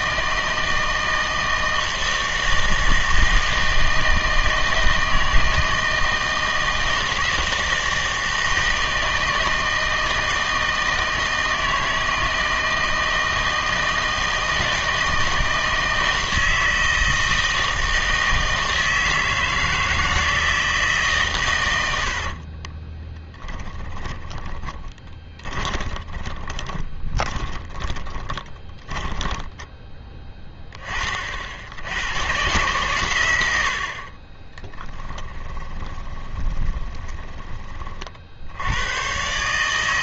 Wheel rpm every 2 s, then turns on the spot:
160, 160, 160, 160, 160, 160, 160, 160, 160, 160, 160, 30, 10, 20, 10, 10, 130, 10, 20, 90.
22-30 34-38